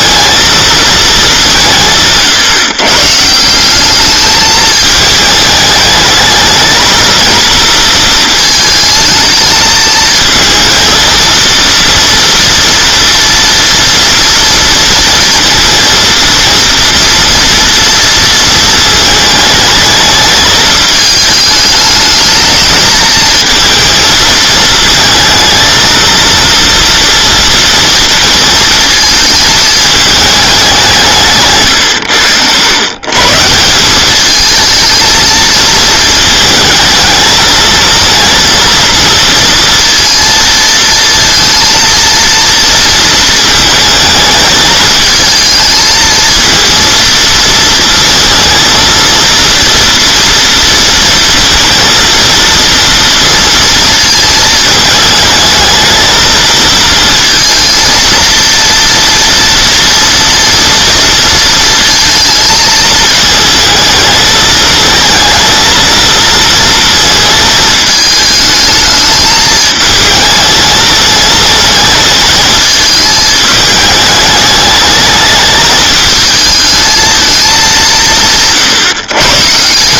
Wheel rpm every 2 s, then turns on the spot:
230, 130, 210, 220, 220, 220, 240, 230, 230, 220, 210, 220, 220, 230, 230, 190, 110, 220, 220, 230, 230, 230, 220, 230, 230, 230, 230, 220, 220, 230, 230, 220, 220, 230, 220, 220, 220, 210, 220, 150.
none